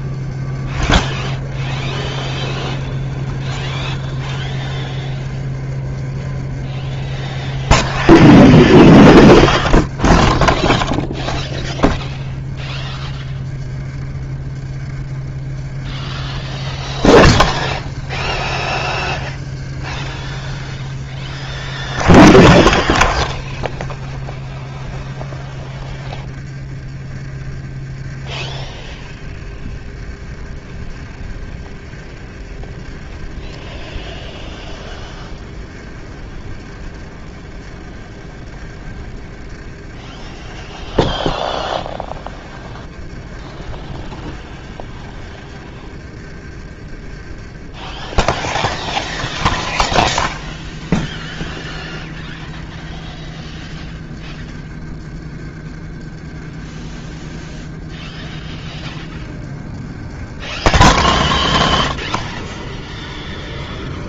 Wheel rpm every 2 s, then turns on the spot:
30, 30, 30, 30, 30, 20, 30, 30, 30, 30, 30, 40, 30, 30, 30, 30, 30, 30, 30, 30, 30, 30, 30, 40, 40, 30, 30, 30, 30, 30, 30, 30.
8-12 22-24 46-50